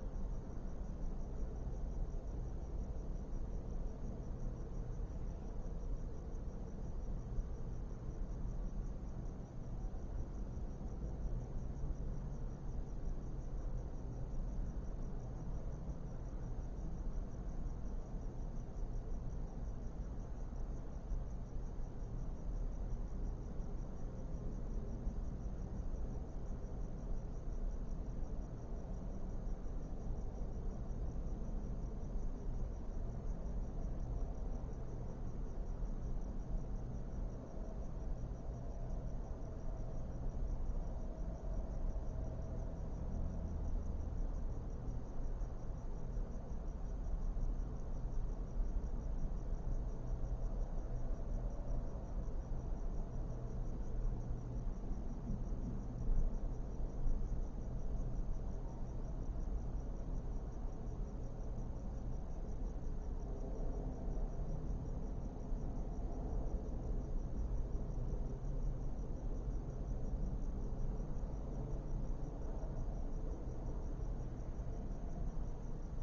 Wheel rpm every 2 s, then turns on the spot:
0, 0, 0, 0, 0, 0, 0, 0, 0, 0, 0, 0, 0, 0, 0, 0, 0, 0, 0, 0, 0, 0, 0, 0, 0, 0, 0, 0, 0, 0, 0, 0, 0, 0, 0, 0, 0, 0.
none